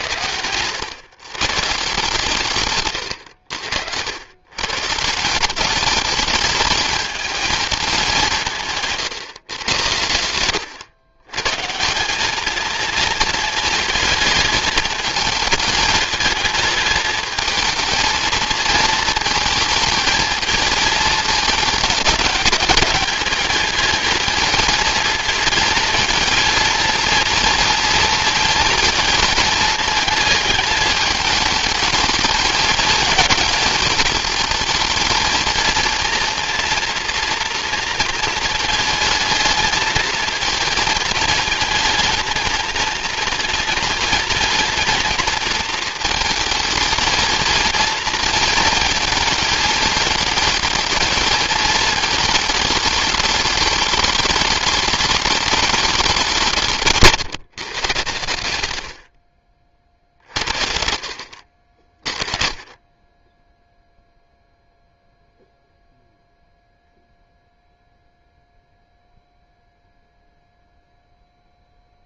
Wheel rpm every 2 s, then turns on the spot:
120, 140, 140, 210, 160, 120, 220, 220, 220, 220, 220, 210, 230, 230, 230, 220, 220, 220, 230, 220, 220, 220, 230, 220, 220, 230, 220, 210, 150, 90, 60, 20, 0, 0, 0, 0.
none